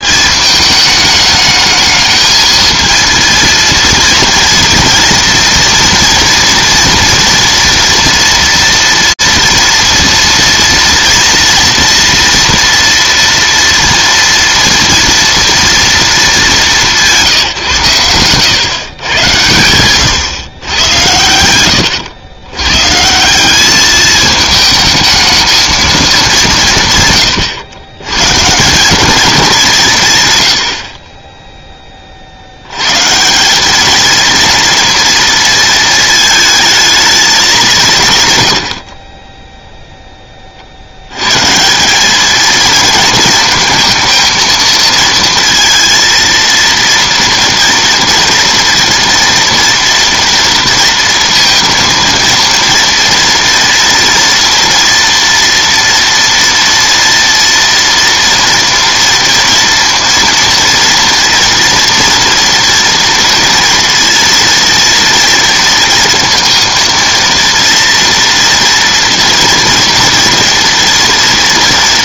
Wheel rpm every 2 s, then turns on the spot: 210, 230, 230, 230, 240, 230, 230, 230, 180, 120, 100, 140, 220, 130, 200, 40, 160, 230, 220, 20, 90, 220, 220, 230, 230, 230, 230, 230, 230, 230, 230, 230, 230, 230, 240, 230.
none